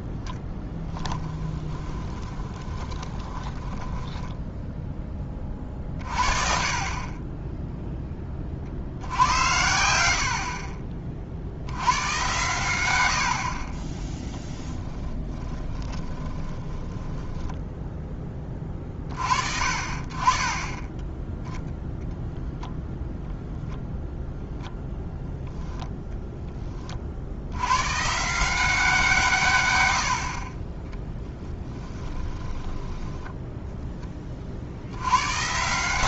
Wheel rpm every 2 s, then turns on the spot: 10, 20, 10, 50, 40, 40, 100, 10, 10, 20, 10, 0, 0, 30, 170, 30, 10, 60.
0-4 14-18 30-34